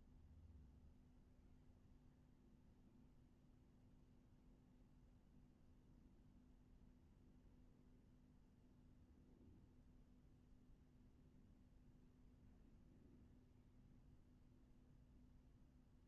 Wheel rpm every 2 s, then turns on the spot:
0, 0, 0, 0, 0, 0, 0, 0.
none